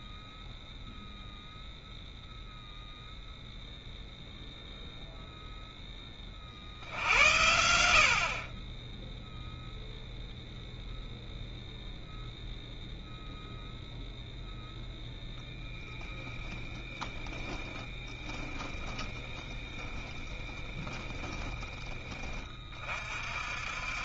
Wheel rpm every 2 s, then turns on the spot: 0, 0, 0, 60, 30, 0, 0, 0, 10, 20, 20, 30.
18-22